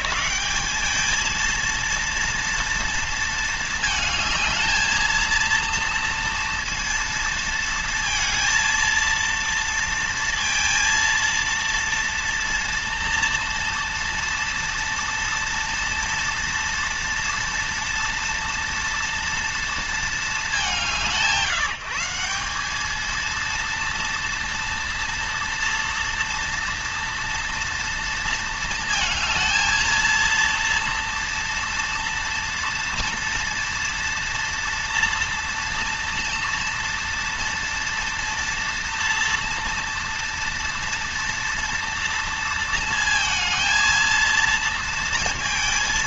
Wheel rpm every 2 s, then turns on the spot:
190, 230, 220, 230, 230, 230, 230, 230, 230, 230, 180, 210, 230, 230, 220, 230, 230, 230, 230, 230, 230, 230, 230.
none